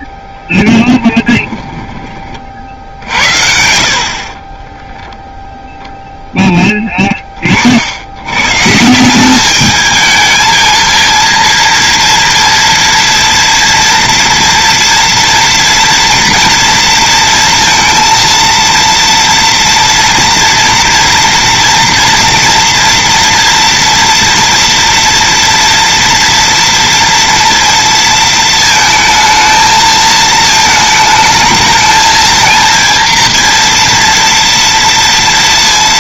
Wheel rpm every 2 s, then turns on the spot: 10, 60, 0, 20, 160, 220, 230, 240, 230, 230, 230, 230, 230, 230, 220, 220, 230, 230.
0-2